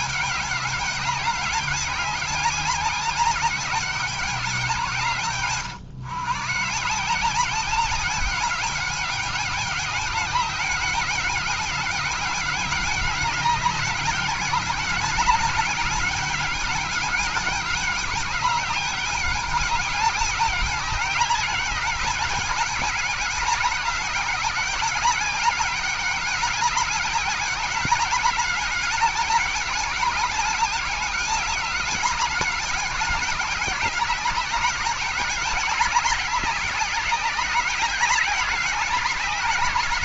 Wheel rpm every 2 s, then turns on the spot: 200, 190, 180, 140, 190, 200, 200, 190, 200, 200, 200, 200, 200, 200, 200, 200, 200, 200, 190, 190.
none